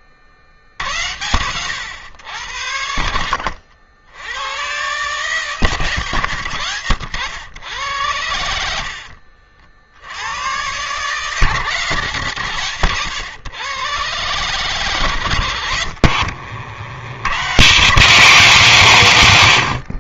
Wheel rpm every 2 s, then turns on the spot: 60, 90, 110, 110, 80, 100, 110, 130, 80, 180.
8-10 16-18